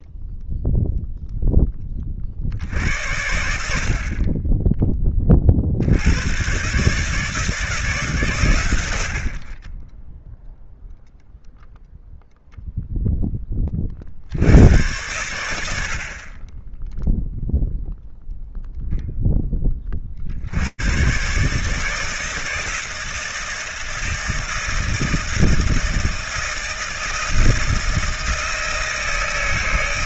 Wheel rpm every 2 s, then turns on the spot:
0, 60, 40, 130, 110, 0, 0, 90, 10, 0, 80, 160, 160, 160, 160.
none